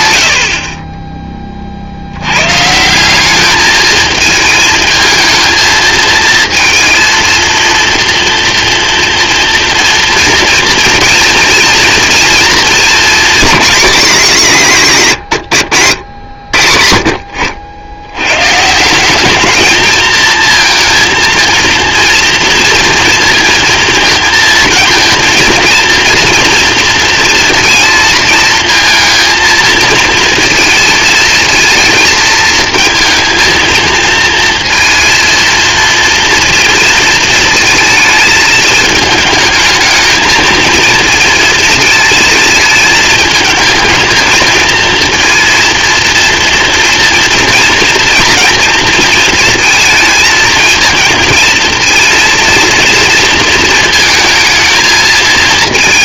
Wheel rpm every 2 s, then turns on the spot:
60, 140, 220, 230, 240, 240, 230, 160, 70, 150, 230, 230, 230, 230, 220, 230, 220, 230, 230, 220, 220, 220, 220, 230, 230, 220, 230, 220.
none